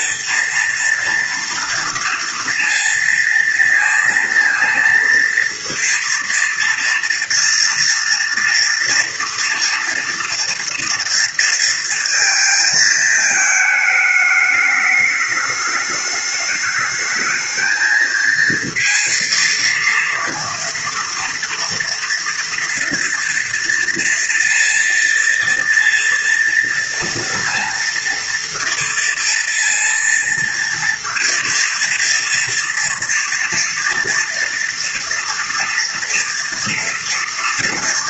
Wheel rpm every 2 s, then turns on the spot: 230, 230, 230, 230, 230, 230, 220, 210, 210, 230, 230, 230, 240, 230, 230, 230, 230, 230, 230.
none